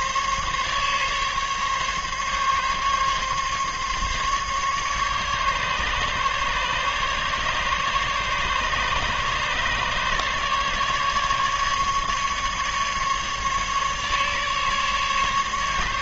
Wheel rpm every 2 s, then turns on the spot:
140, 140, 140, 140, 150, 150, 150, 150.
none